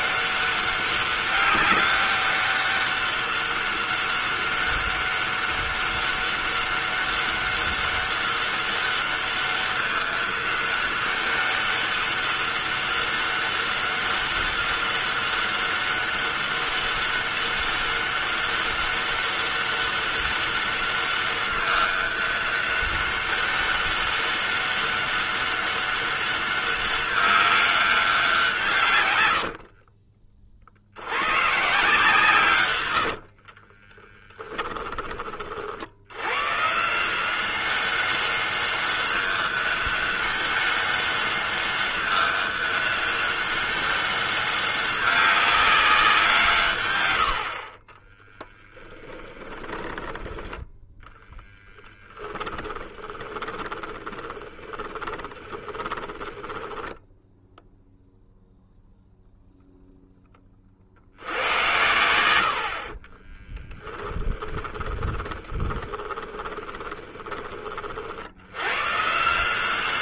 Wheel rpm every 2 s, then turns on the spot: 200, 200, 200, 200, 200, 200, 200, 200, 200, 200, 200, 200, 200, 200, 160, 60, 120, 10, 130, 200, 200, 200, 200, 140, 10, 10, 10, 20, 10, 0, 40, 60, 20, 20, 100.
32-34 48-50 52-58 64-68